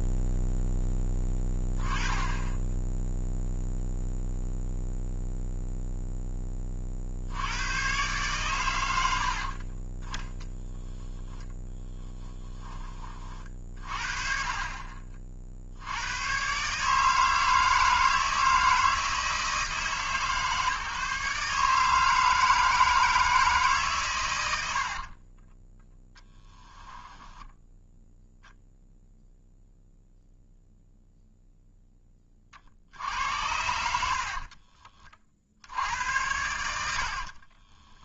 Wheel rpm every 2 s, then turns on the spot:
10, 10, 0, 20, 110, 0, 10, 40, 140, 160, 150, 160, 80, 10, 0, 0, 50, 30, 90.
14-16 24-28 34-36